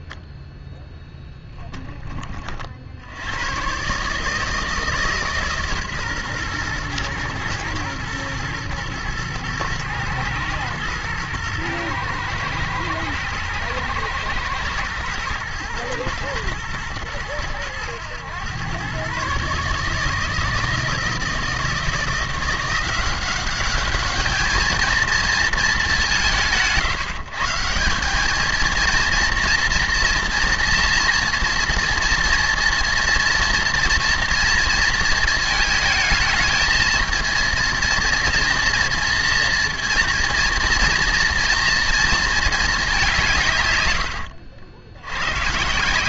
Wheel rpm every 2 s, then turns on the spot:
0, 70, 150, 120, 120, 110, 110, 120, 110, 130, 160, 180, 220, 140, 230, 230, 230, 230, 230, 230, 230, 190, 90.
none